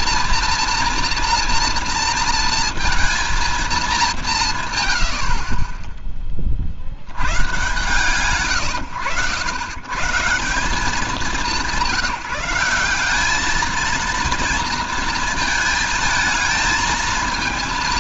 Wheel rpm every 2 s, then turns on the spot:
240, 230, 140, 50, 120, 180, 180, 230, 220.
none